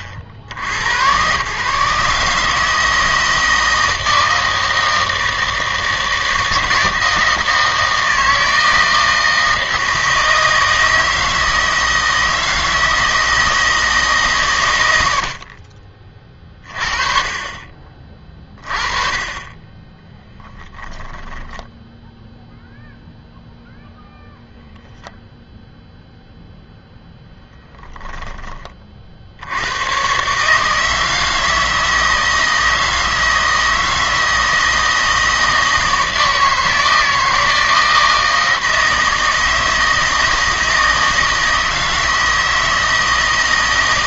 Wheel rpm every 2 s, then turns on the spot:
70, 160, 160, 160, 160, 160, 160, 100, 30, 30, 10, 0, 0, 0, 40, 160, 160, 160, 160, 160, 160, 160.
20-22